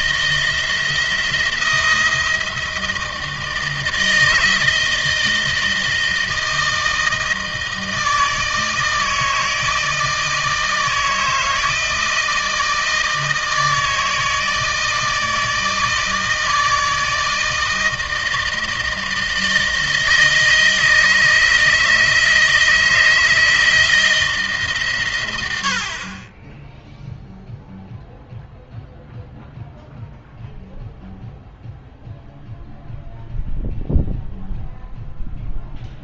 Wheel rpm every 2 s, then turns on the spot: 170, 160, 160, 160, 160, 160, 160, 160, 160, 160, 160, 160, 130, 0, 0, 0, 0, 0.
none